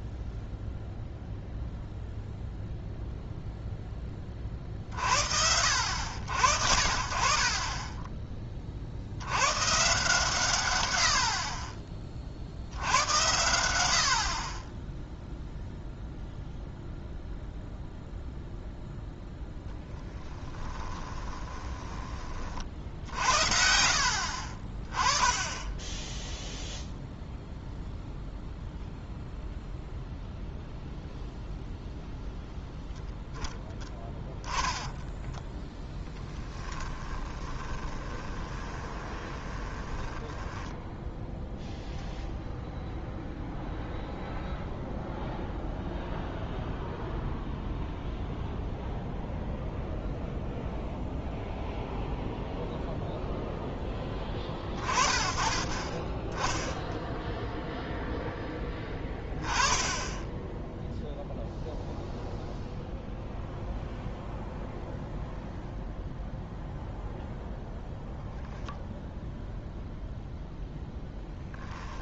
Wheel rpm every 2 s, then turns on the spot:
0, 0, 40, 60, 40, 120, 60, 30, 0, 0, 20, 40, 40, 0, 0, 0, 0, 10, 10, 20, 10, 0, 0, 0, 0, 0, 0, 30, 10, 10, 10, 0, 0, 0, 0, 0.
20-22 36-42